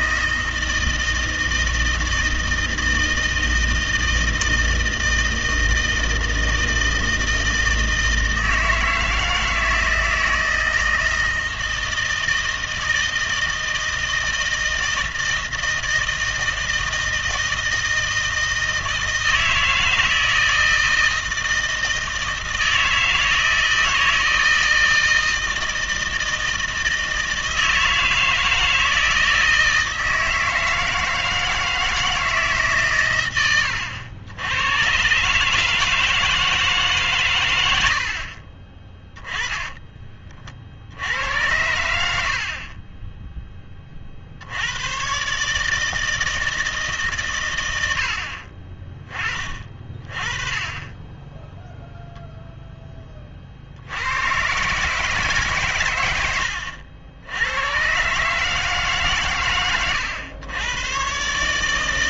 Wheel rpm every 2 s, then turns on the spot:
160, 160, 160, 160, 160, 160, 160, 160, 160, 160, 160, 160, 160, 160, 160, 160, 140, 110, 160, 30, 60, 40, 100, 160, 40, 20, 10, 150, 80, 150, 110.
none